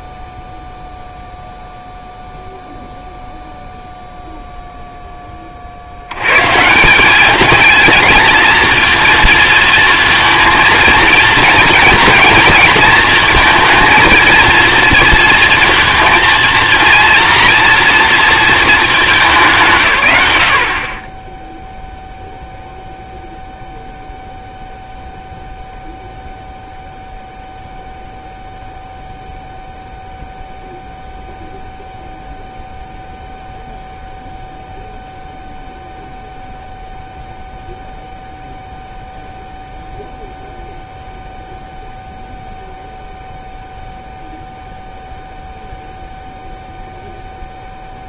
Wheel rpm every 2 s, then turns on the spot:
0, 0, 0, 160, 230, 230, 230, 230, 230, 220, 60, 0, 0, 0, 0, 0, 0, 0, 0, 0, 0, 0, 0, 0.
none